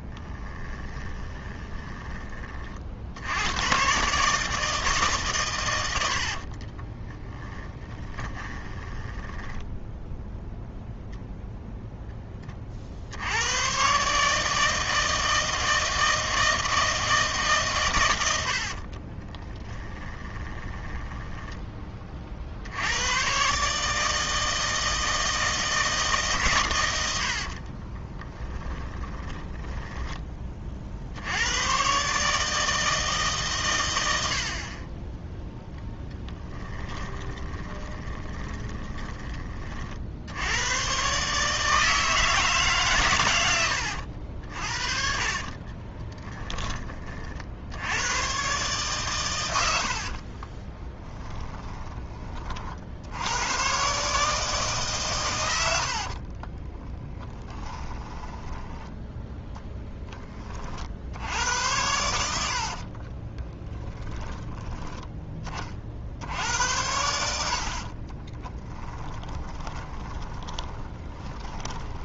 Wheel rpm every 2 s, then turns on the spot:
20, 40, 150, 30, 20, 0, 50, 160, 160, 50, 20, 90, 160, 110, 10, 50, 160, 30, 10, 10, 120, 140, 50, 20, 130, 20, 60, 140, 10, 10, 50, 50, 10, 80, 10, 20.
0-2 6-10 18-22 36-40 50-52 56-60 62-64 68-72